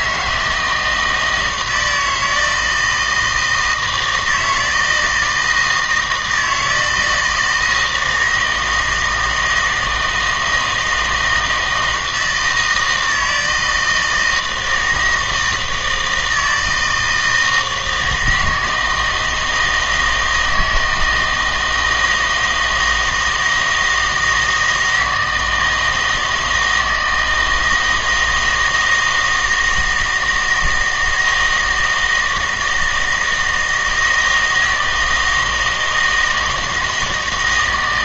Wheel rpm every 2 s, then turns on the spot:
160, 160, 160, 160, 160, 160, 160, 160, 160, 160, 160, 160, 160, 160, 160, 160, 160, 160, 160.
none